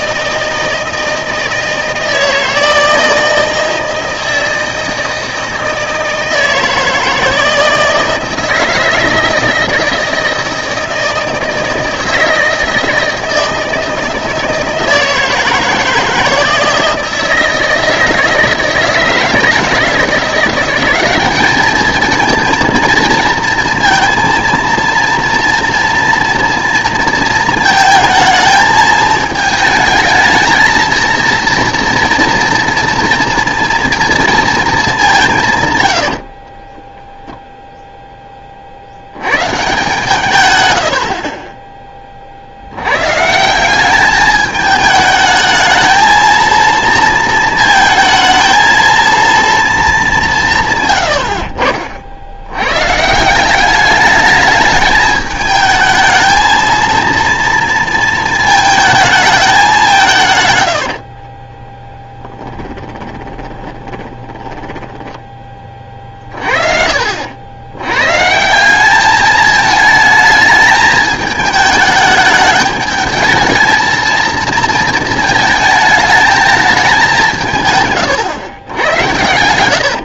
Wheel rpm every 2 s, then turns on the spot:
160, 160, 160, 160, 160, 160, 160, 160, 160, 160, 190, 230, 230, 230, 220, 220, 230, 210, 20, 50, 100, 90, 220, 230, 230, 150, 120, 210, 230, 220, 90, 20, 20, 50, 190, 220, 210, 220, 210, 100.
36-38 60-66